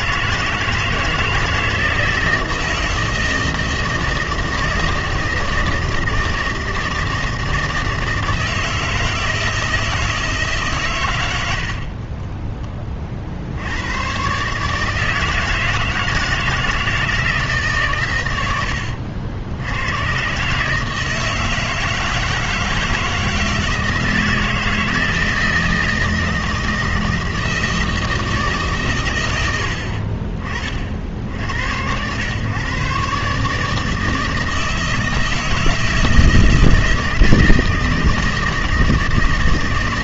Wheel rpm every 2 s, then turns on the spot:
160, 160, 160, 160, 160, 140, 20, 140, 160, 90, 140, 160, 160, 160, 140, 50, 130, 160, 170, 160.
none